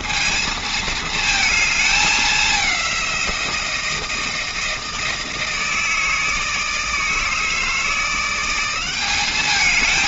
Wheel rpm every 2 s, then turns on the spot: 220, 200, 160, 160, 180.
none